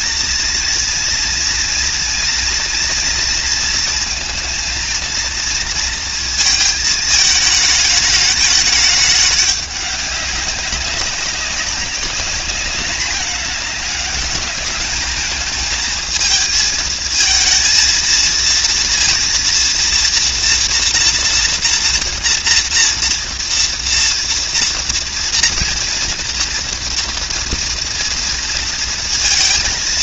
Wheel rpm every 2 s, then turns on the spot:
230, 230, 230, 220, 210, 200, 200, 210, 220, 230, 240, 230, 230, 230, 230.
none